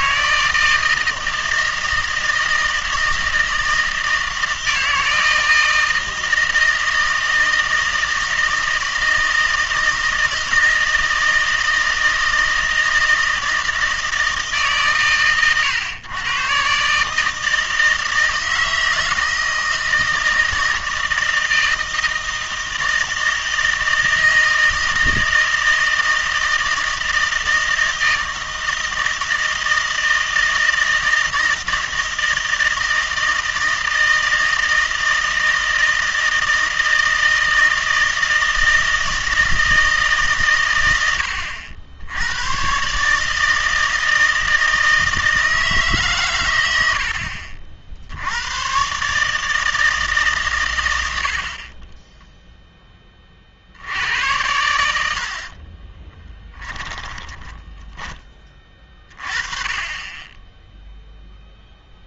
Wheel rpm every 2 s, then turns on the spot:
160, 160, 160, 160, 160, 160, 160, 150, 140, 160, 160, 160, 160, 160, 160, 160, 160, 160, 160, 160, 120, 130, 160, 80, 120, 110, 10, 90, 10, 20, 0.
56-58